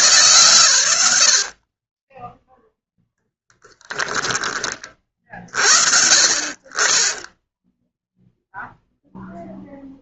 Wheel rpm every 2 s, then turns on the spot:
110, 0, 30, 40, 0.
none